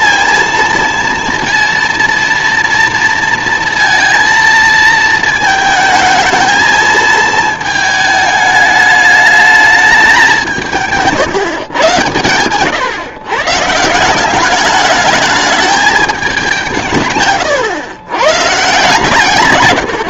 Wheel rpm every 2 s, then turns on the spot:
230, 230, 230, 220, 210, 170, 120, 210, 180, 140.
none